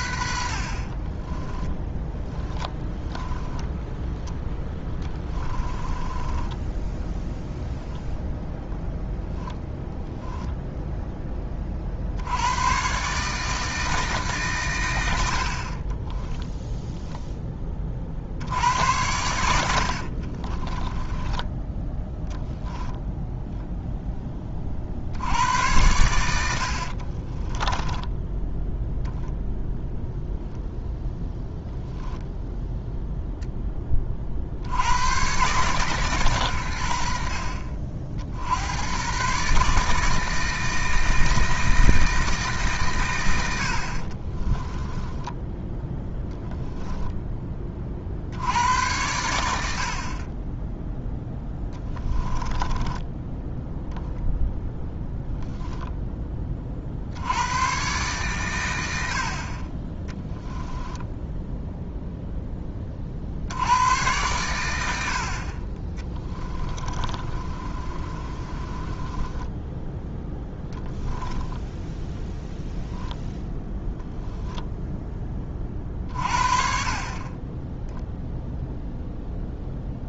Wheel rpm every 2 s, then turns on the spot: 70, 10, 10, 10, 10, 10, 130, 110, 0, 80, 10, 0, 50, 60, 0, 0, 0, 90, 80, 120, 160, 130, 10, 0, 100, 10, 10, 0, 60, 90, 10, 30, 90, 30, 20, 10, 10, 10, 40, 0.
2-8 20-22 26-28 44-46 52-54 60-62 66-74